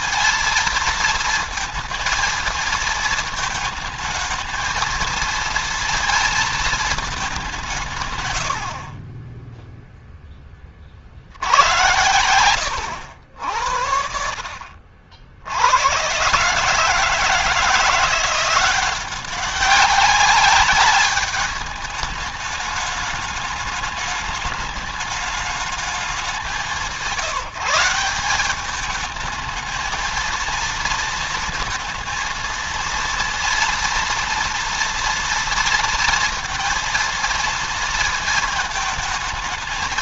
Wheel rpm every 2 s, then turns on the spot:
230, 220, 220, 230, 100, 20, 100, 60, 140, 180, 200, 210, 210, 180, 200, 230, 230, 230, 230, 220.
12-14